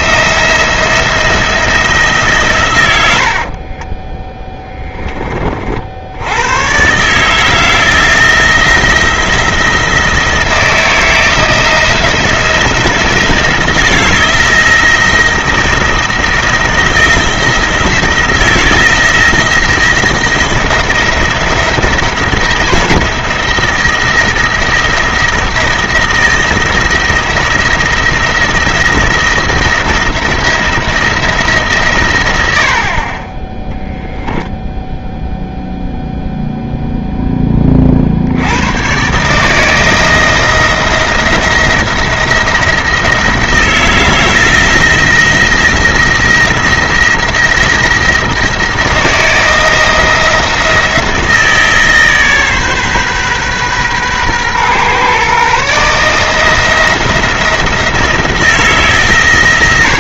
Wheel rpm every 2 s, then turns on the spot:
170, 100, 10, 120, 170, 160, 160, 170, 170, 170, 160, 170, 170, 170, 170, 170, 50, 0, 0, 120, 170, 170, 160, 170, 170, 160, 140, 130, 160, 150.
2-4